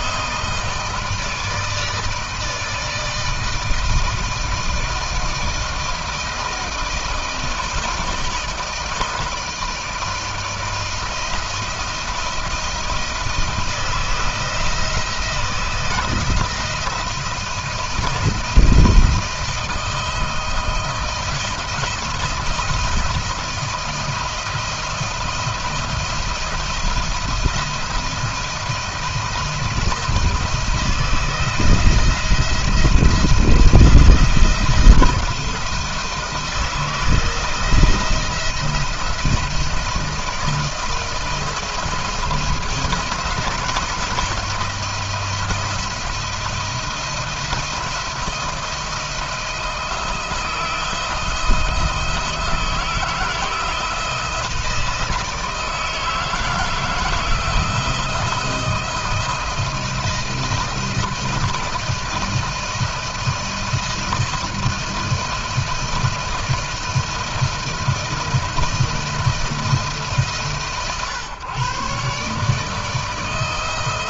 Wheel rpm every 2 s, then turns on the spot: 160, 160, 160, 160, 160, 160, 170, 160, 170, 160, 160, 160, 170, 170, 160, 160, 170, 160, 170, 170, 160, 170, 170, 160, 170, 160, 160, 160, 160, 160, 160, 160, 160, 160, 170, 140, 160.
none